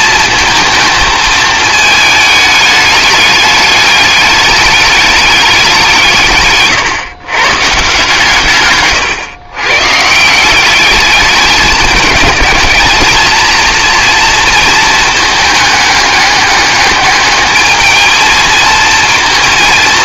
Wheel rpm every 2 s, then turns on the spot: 220, 210, 210, 130, 130, 200, 210, 220, 210, 230.
none